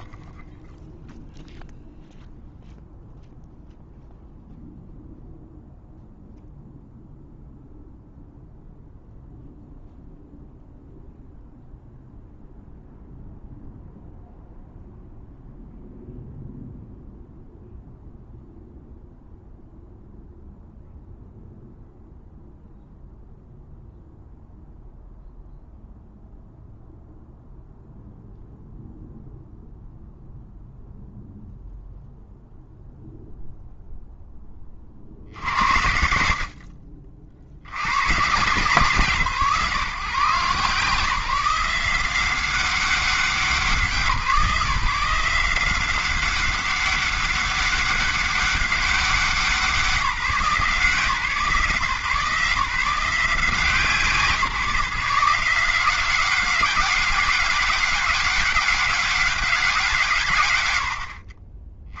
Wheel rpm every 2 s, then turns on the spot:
0, 0, 0, 0, 0, 0, 0, 0, 0, 0, 0, 0, 0, 0, 0, 0, 0, 10, 60, 140, 150, 190, 160, 200, 200, 160, 160, 170, 200, 200, 130.
none